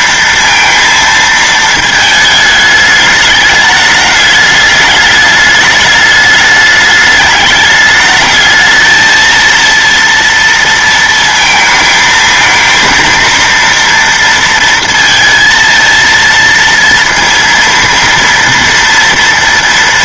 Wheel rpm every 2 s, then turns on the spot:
230, 210, 210, 210, 220, 230, 220, 230, 230, 240.
none